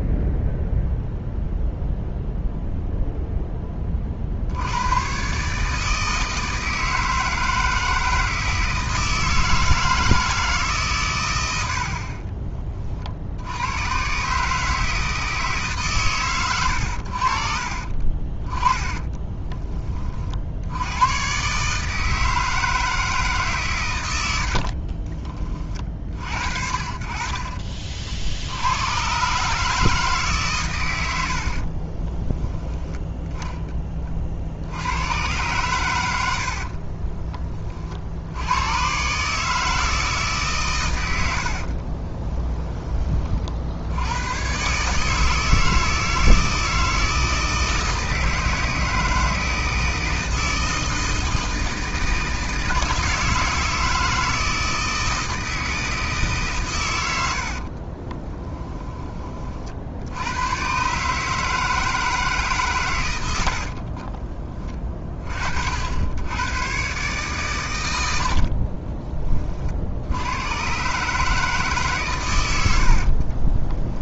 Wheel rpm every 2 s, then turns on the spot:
0, 0, 90, 160, 160, 150, 30, 150, 90, 20, 80, 160, 50, 50, 90, 120, 10, 80, 40, 100, 130, 10, 140, 160, 160, 160, 160, 160, 120, 10, 120, 130, 30, 130, 40, 130, 70.
18-20 24-26 36-38 68-70